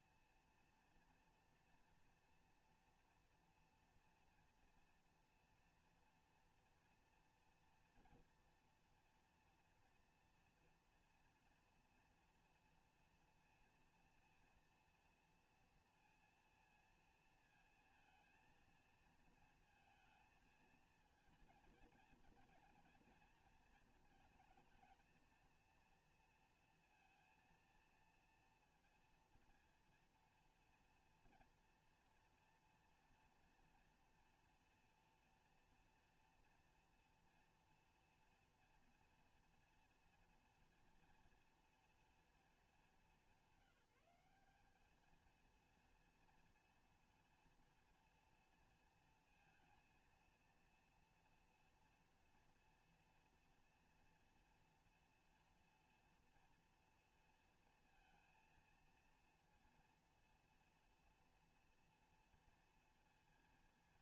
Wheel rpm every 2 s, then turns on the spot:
230, 240, 230, 230, 230, 230, 230, 230, 230, 230, 230, 240, 230, 230, 230, 230, 230, 230, 230, 230, 230, 220, 200, 230, 230, 230, 230, 230, 230, 230, 230, 230.
none